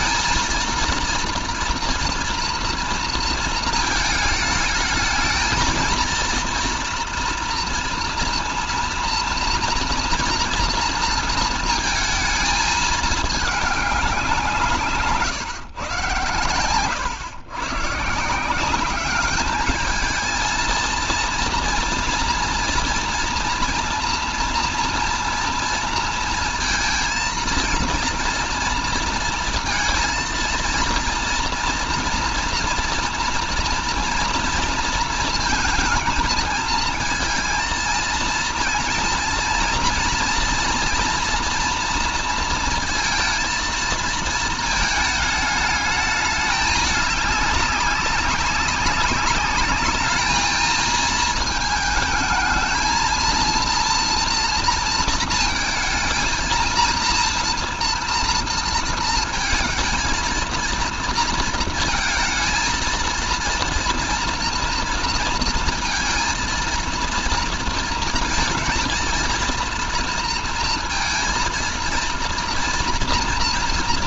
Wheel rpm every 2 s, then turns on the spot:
230, 230, 220, 230, 240, 230, 220, 170, 120, 180, 220, 230, 230, 230, 230, 230, 230, 230, 230, 230, 230, 230, 220, 210, 200, 220, 220, 230, 230, 230, 230, 230, 230, 230, 230, 230, 230.
none